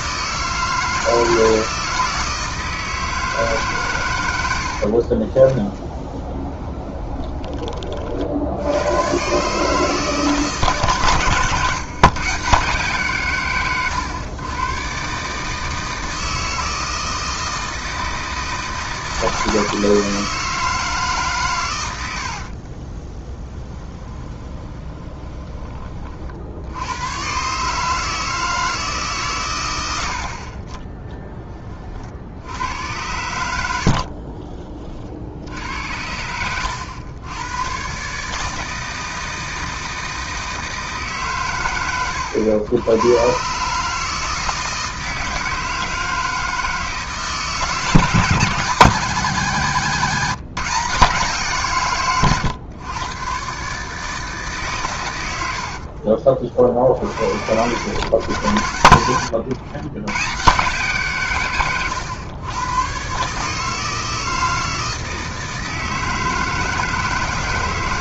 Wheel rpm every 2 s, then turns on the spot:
160, 160, 40, 20, 120, 130, 140, 130, 160, 160, 150, 20, 20, 100, 140, 10, 90, 50, 100, 160, 140, 110, 160, 160, 160, 150, 120, 110, 50, 90, 140, 140, 160, 160.
4-8 22-26 58-60